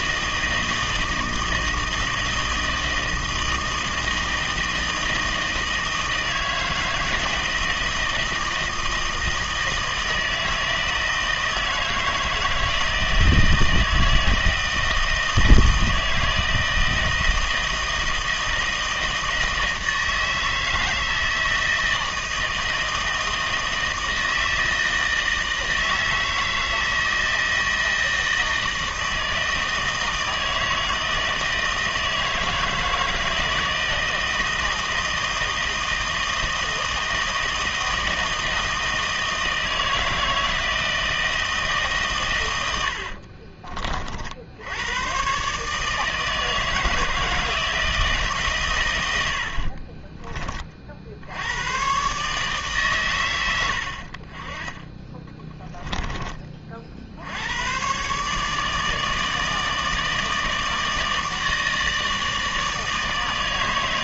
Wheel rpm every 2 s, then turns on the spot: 160, 160, 160, 160, 160, 160, 160, 160, 160, 160, 160, 160, 160, 160, 160, 160, 160, 160, 160, 160, 160, 90, 90, 160, 120, 40, 140, 30, 40, 150, 160, 160.
42-44 54-56